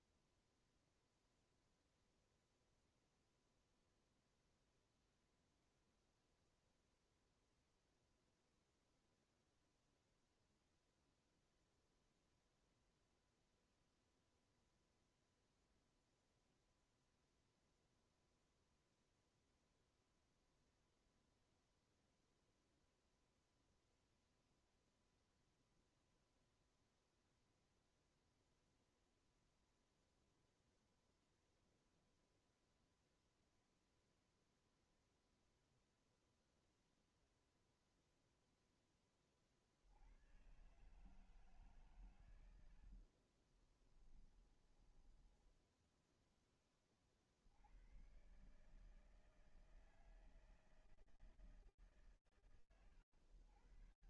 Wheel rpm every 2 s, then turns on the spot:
0, 0, 0, 0, 0, 0, 0, 0, 0, 0, 0, 0, 0, 0, 0, 0, 0, 0, 0, 0, 100, 130, 20, 10, 100, 160, 120.
44-46